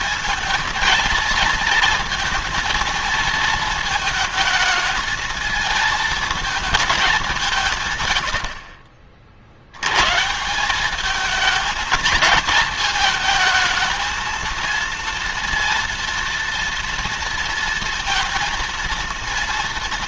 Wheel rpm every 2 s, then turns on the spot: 230, 220, 220, 220, 60, 190, 220, 230, 230, 230.
none